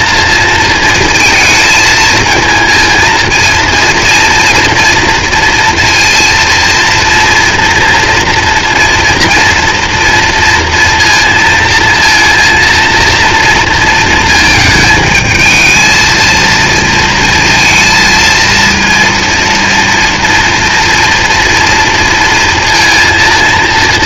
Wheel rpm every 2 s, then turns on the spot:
230, 220, 240, 230, 230, 230, 230, 220, 230, 230, 230, 230.
none